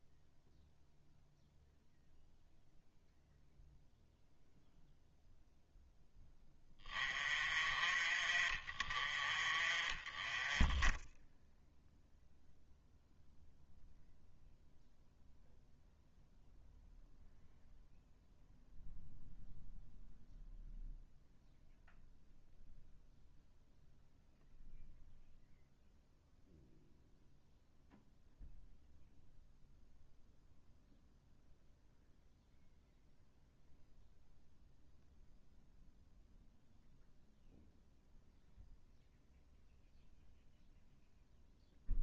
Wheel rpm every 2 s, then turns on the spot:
0, 0, 0, 10, 40, 10, 0, 0, 0, 0, 0, 0, 0, 0, 0, 0, 0, 0, 0, 0, 0.
none